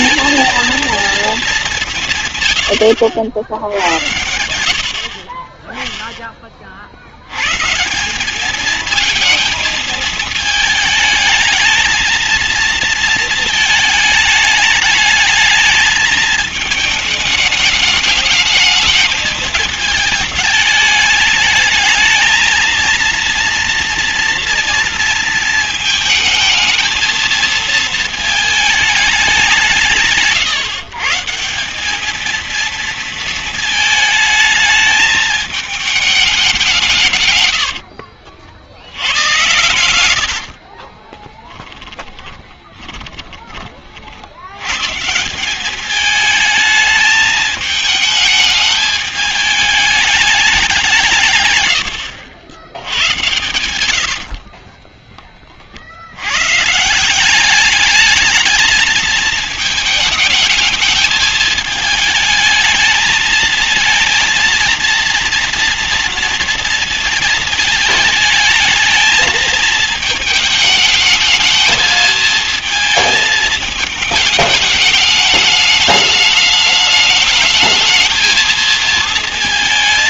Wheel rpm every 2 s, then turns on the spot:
230, 130, 80, 30, 200, 220, 230, 210, 220, 220, 220, 220, 230, 220, 220, 150, 230, 220, 190, 60, 60, 20, 100, 210, 220, 200, 80, 60, 120, 220, 220, 220, 230, 230, 220, 220, 220, 210, 210, 220.
40-44 54-56